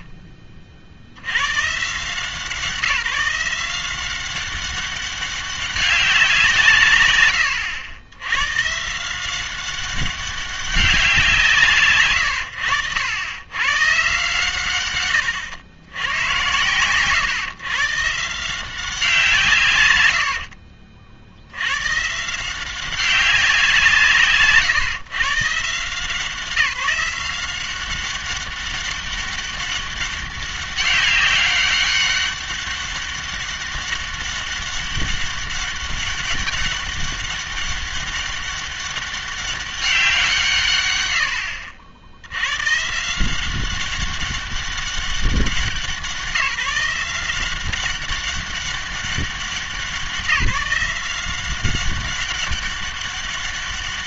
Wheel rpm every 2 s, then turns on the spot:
40, 170, 190, 160, 130, 190, 90, 120, 110, 180, 60, 180, 140, 180, 200, 200, 200, 200, 200, 200, 130, 120, 200, 170, 200, 180, 200.
20-22